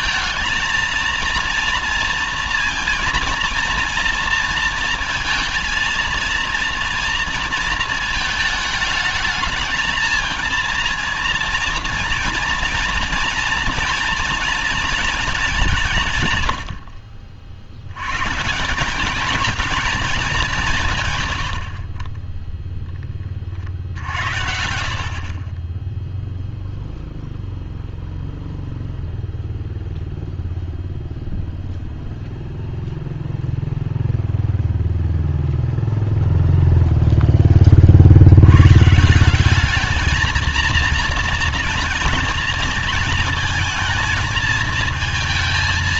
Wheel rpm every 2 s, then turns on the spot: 220, 230, 230, 230, 220, 230, 230, 230, 100, 160, 190, 10, 70, 0, 0, 0, 0, 0, 0, 110, 230, 230, 220.
none